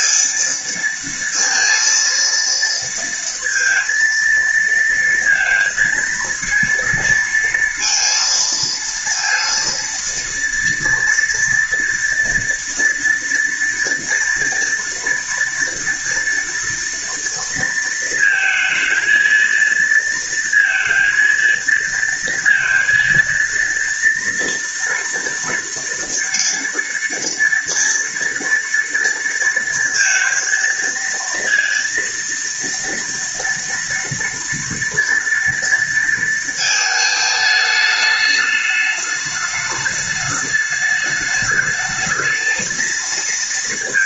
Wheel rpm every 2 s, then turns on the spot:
230, 230, 230, 230, 230, 230, 240, 230, 230, 230, 230, 230, 230, 230, 230, 230, 230, 230, 220, 210, 210, 220.
none